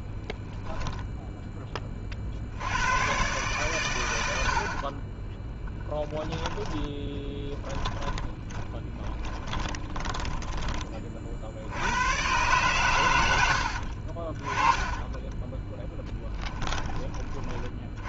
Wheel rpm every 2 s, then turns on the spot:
70, 40, 10, 20, 30, 110, 40, 10, 70.
4-10 14-16